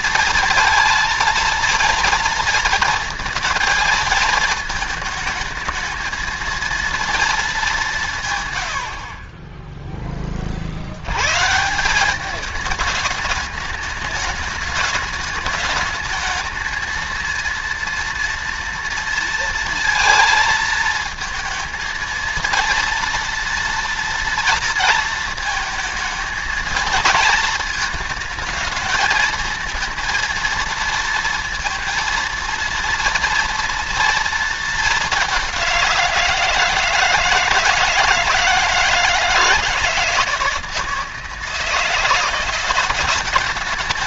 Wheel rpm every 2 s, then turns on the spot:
230, 230, 220, 230, 60, 90, 210, 210, 230, 230, 220, 230, 230, 220, 220, 230, 230, 210, 160, 160, 160, 190.
none